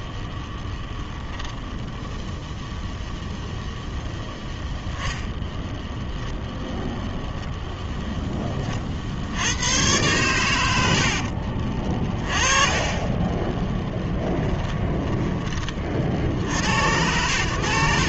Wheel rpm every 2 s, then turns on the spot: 0, 0, 0, 0, 30, 100, 30, 10, 90.
none